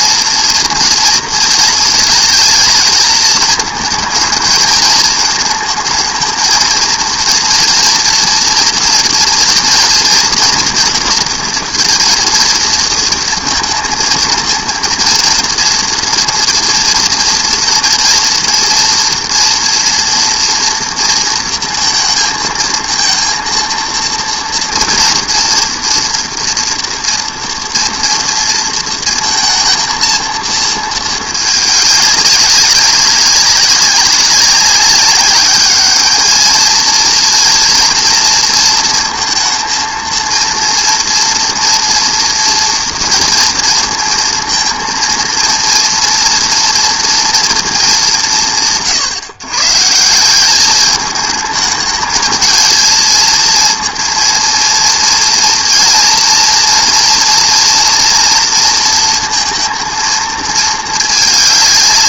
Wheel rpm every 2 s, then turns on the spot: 240, 220, 220, 220, 230, 240, 230, 230, 240, 230, 230, 230, 230, 230, 230, 230, 190, 200, 220, 230, 230, 230, 230, 240, 180, 190, 220, 230, 230, 230, 220.
none